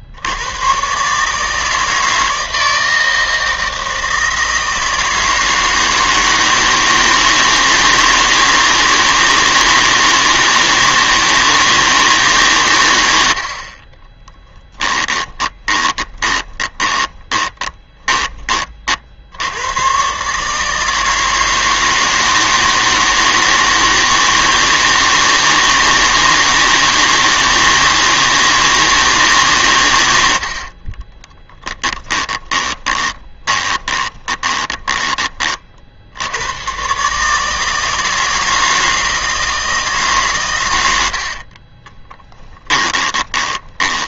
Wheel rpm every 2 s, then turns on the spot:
110, 160, 160, 160, 160, 160, 130, 10, 20, 30, 160, 160, 160, 160, 160, 50, 20, 20, 110, 160, 100, 10.
14-18 30-36 42-44